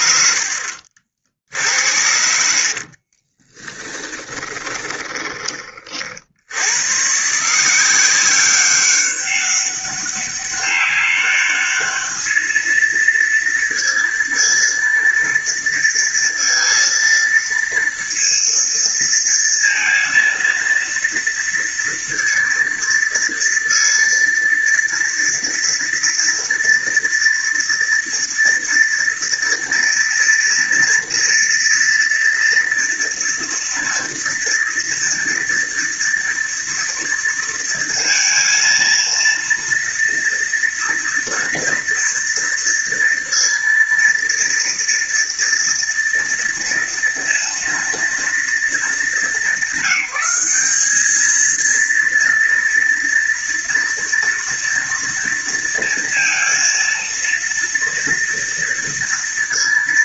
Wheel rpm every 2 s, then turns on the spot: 60, 50, 20, 110, 190, 200, 220, 230, 230, 230, 230, 230, 230, 230, 230, 240, 230, 230, 230, 230, 230, 230, 230, 230, 220, 210, 230, 230, 230, 230.
0-6